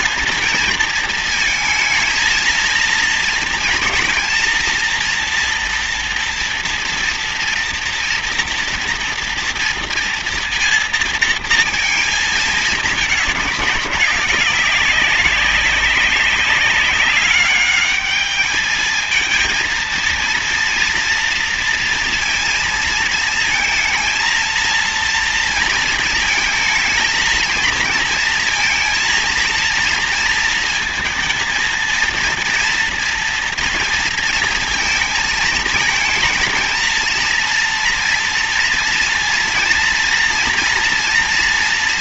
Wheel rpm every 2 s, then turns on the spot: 230, 230, 230, 230, 230, 230, 220, 200, 200, 220, 230, 230, 230, 220, 230, 230, 230, 230, 220, 230, 240.
none